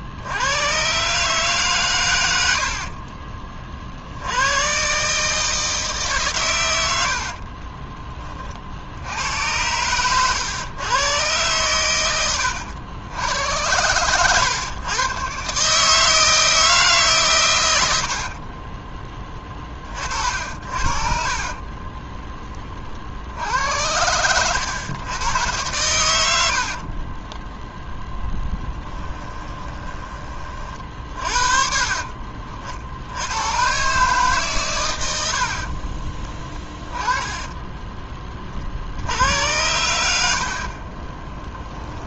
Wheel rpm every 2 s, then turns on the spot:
130, 50, 130, 90, 70, 110, 100, 120, 150, 20, 60, 50, 110, 40, 10, 40, 70, 110, 20, 70, 30.
6-8 26-30 36-38 40-42